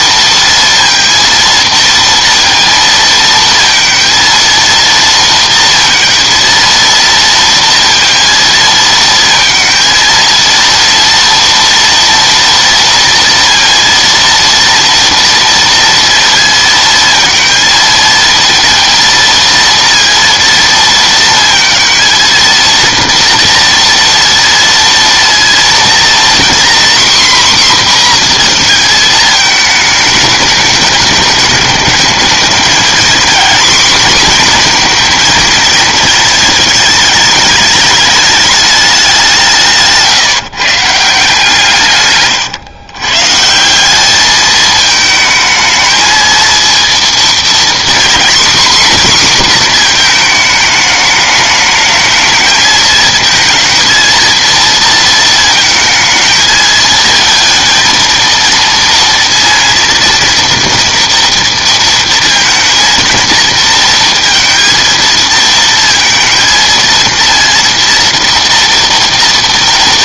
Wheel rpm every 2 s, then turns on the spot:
230, 230, 230, 230, 230, 230, 230, 230, 230, 220, 230, 230, 230, 250, 240, 210, 220, 240, 220, 210, 150, 140, 220, 230, 250, 220, 220, 230, 220, 230, 230, 230, 230, 230, 230.
none